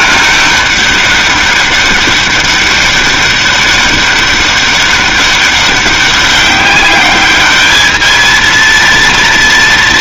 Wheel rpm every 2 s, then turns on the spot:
200, 200, 200, 200, 230.
none